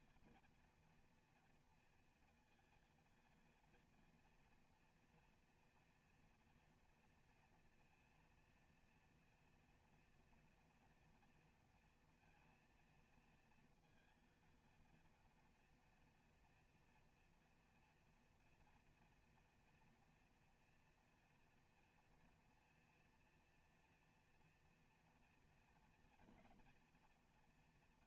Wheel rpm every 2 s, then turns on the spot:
230, 230, 240, 230, 230, 230, 230, 230, 230, 230, 240, 230, 230, 230.
none